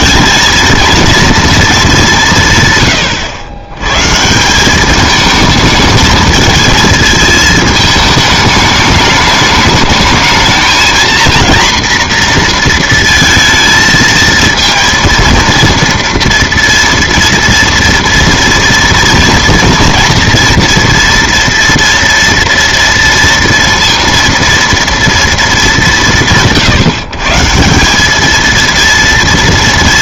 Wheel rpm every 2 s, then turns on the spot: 230, 140, 190, 220, 210, 220, 230, 230, 240, 240, 230, 230, 230, 160, 220.
none